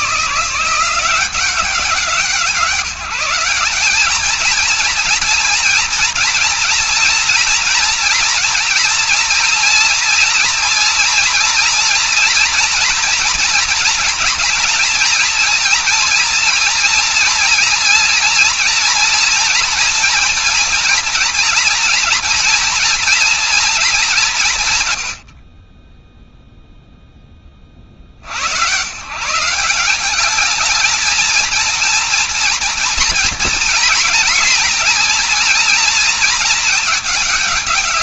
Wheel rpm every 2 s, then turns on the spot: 170, 180, 220, 230, 230, 240, 240, 230, 230, 230, 230, 230, 170, 0, 80, 200, 220, 230, 220.
none